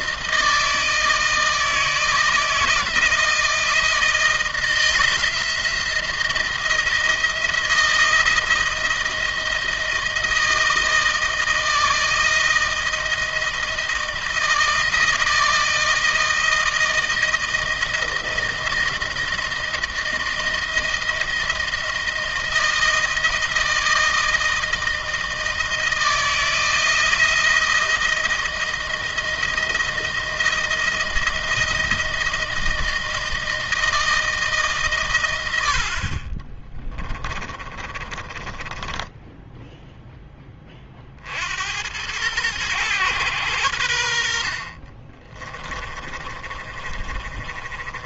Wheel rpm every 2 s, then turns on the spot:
160, 160, 170, 160, 160, 160, 160, 160, 160, 170, 170, 160, 160, 160, 170, 170, 160, 140, 30, 10, 40, 110, 40, 30.
36-40 44-48